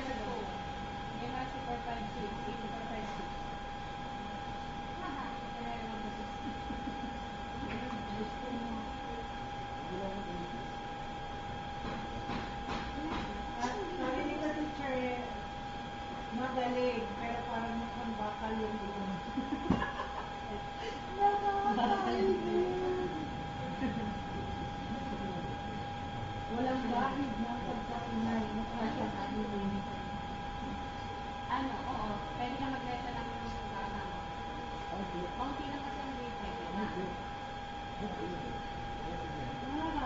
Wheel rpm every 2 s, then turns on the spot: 0, 0, 0, 0, 0, 0, 0, 0, 0, 0, 0, 0, 0, 0, 0, 0, 0, 0, 0, 0.
none